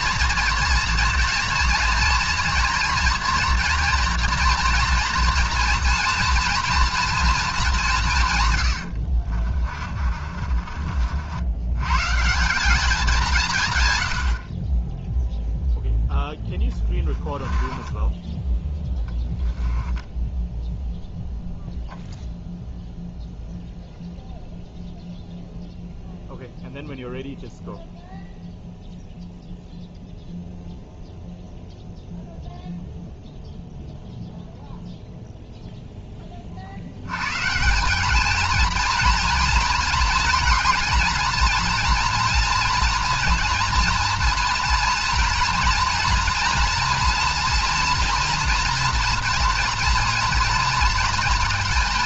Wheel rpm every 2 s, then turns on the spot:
230, 230, 230, 230, 120, 40, 180, 50, 10, 10, 0, 0, 0, 0, 0, 0, 0, 0, 60, 220, 230, 230, 230, 240, 230, 230.
8-12 16-18